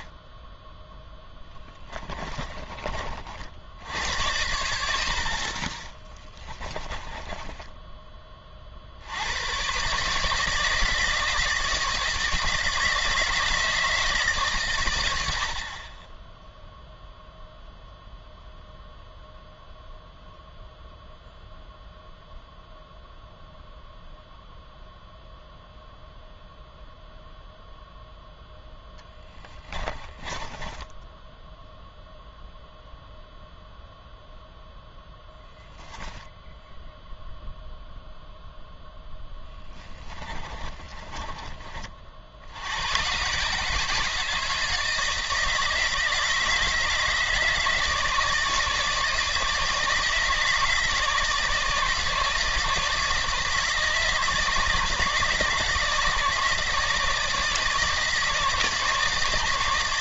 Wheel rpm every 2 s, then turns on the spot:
10, 30, 80, 20, 40, 150, 160, 130, 0, 0, 0, 0, 0, 0, 0, 10, 0, 0, 0, 0, 40, 70, 160, 160, 160, 160, 160, 160, 160, 160.
4-8 30-32 40-42